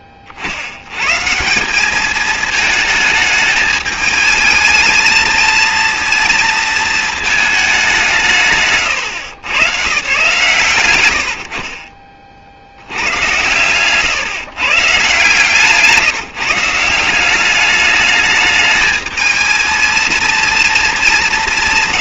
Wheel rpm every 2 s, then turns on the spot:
40, 220, 220, 230, 150, 130, 50, 140, 150, 210, 230.
none